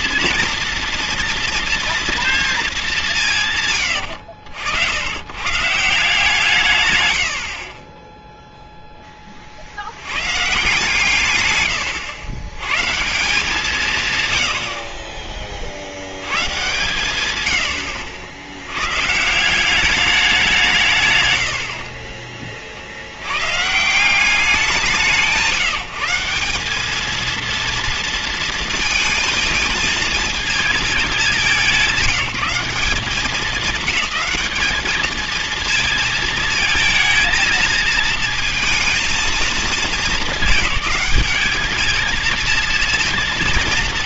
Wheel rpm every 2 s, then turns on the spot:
240, 230, 80, 150, 0, 150, 120, 90, 130, 100, 170, 40, 190, 190, 230, 220, 170, 210, 230, 220, 210, 230.
16-18